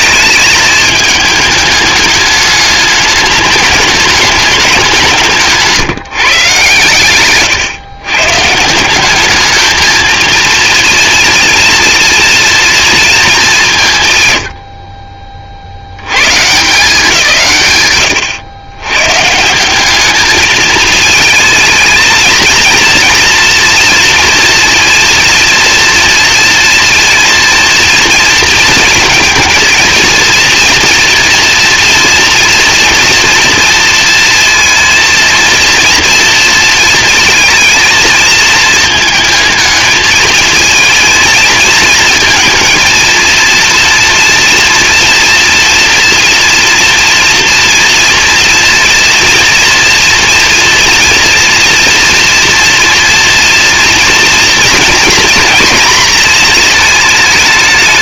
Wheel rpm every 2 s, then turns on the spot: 210, 210, 180, 130, 170, 240, 230, 50, 150, 120, 220, 230, 230, 230, 230, 230, 240, 230, 230, 220, 230, 230, 230, 230, 240, 230, 240, 230, 220.
none